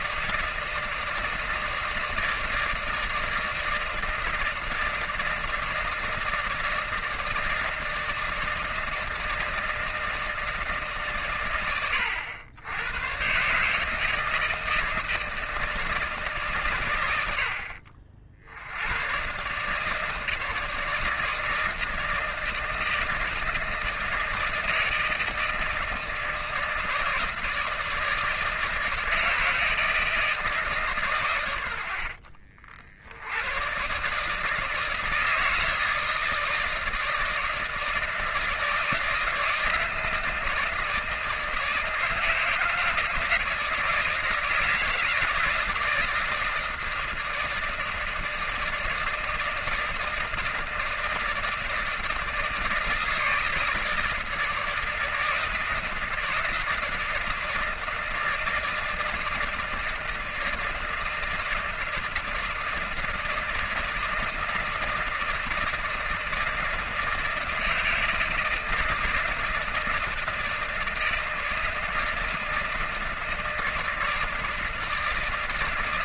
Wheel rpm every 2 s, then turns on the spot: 160, 160, 160, 160, 160, 140, 100, 160, 110, 100, 160, 160, 160, 160, 160, 130, 60, 160, 160, 160, 160, 160, 160, 160, 160, 160, 160, 160, 160, 160, 160, 160, 160, 160, 160, 160, 160, 160.
none